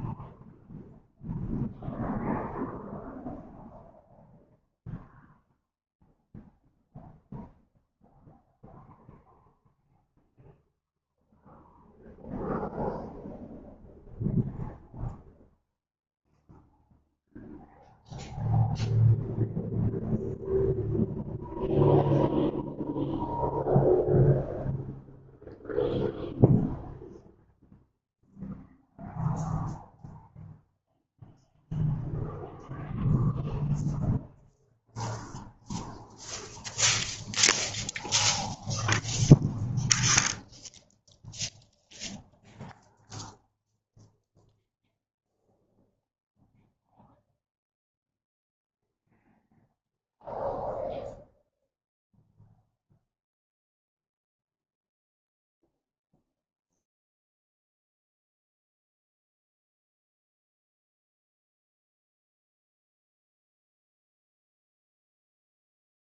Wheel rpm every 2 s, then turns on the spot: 0, 0, 0, 0, 0, 0, 0, 0, 0, 0, 0, 0, 0, 0, 0, 0, 0, 0, 0, 0, 0, 0, 0, 0, 0, 0, 0, 0, 0, 0, 0, 0, 0.
none